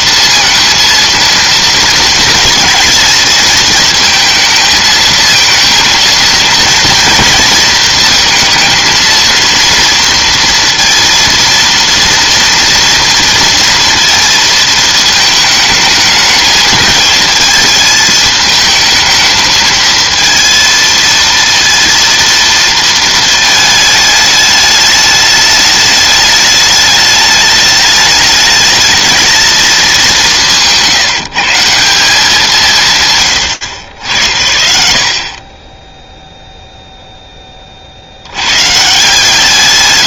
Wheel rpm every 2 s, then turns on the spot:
230, 220, 220, 230, 230, 230, 230, 220, 220, 220, 230, 230, 210, 210, 220, 170, 130, 50, 0, 130.
none